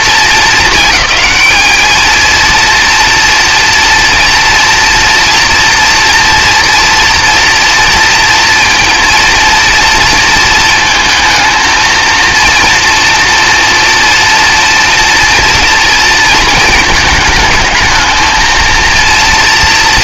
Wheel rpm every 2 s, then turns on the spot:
220, 230, 230, 240, 230, 230, 230, 230, 220, 220.
none